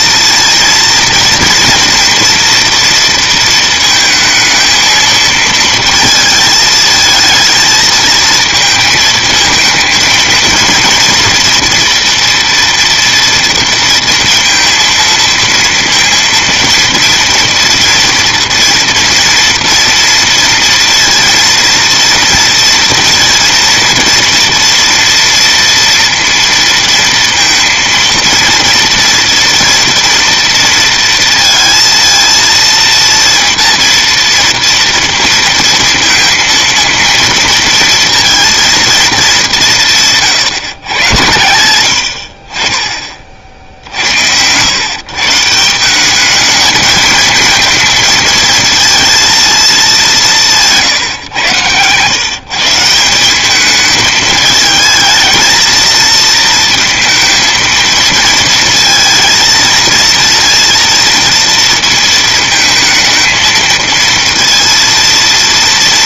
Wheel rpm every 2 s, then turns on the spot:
230, 240, 220, 220, 220, 230, 230, 230, 230, 230, 230, 230, 230, 230, 230, 230, 230, 230, 230, 230, 120, 30, 100, 210, 220, 170, 150, 220, 230, 230, 230, 220, 230.
none